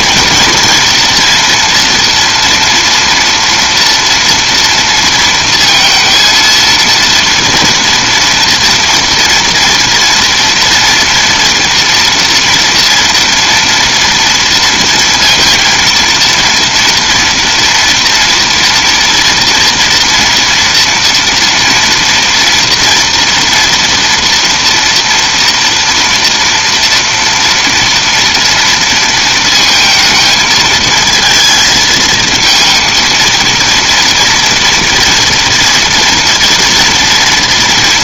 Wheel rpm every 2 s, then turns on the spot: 230, 230, 230, 230, 230, 230, 230, 230, 230, 240, 230, 230, 230, 230, 230, 220, 230, 230, 230.
none